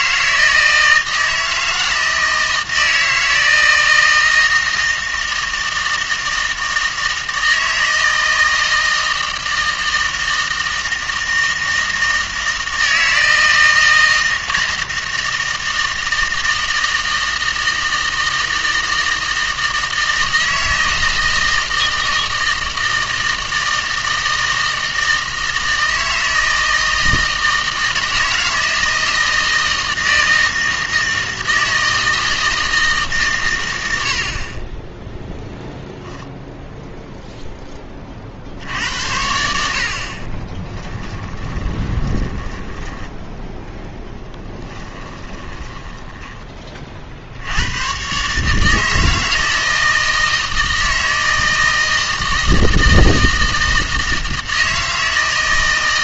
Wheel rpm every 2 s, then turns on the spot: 160, 160, 160, 160, 160, 160, 160, 160, 160, 160, 160, 160, 160, 160, 160, 160, 160, 30, 0, 60, 20, 10, 10, 30, 160, 160, 160, 160.
40-46